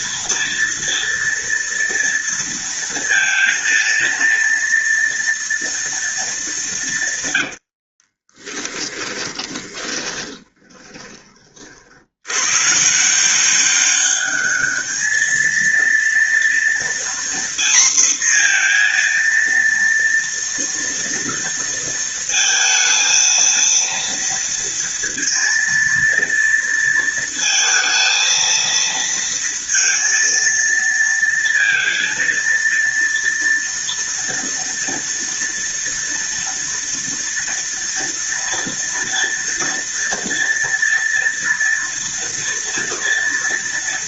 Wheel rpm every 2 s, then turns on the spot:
230, 230, 230, 140, 10, 20, 140, 210, 240, 240, 230, 230, 230, 230, 230, 230, 230, 230, 230, 230, 230, 230.
8-12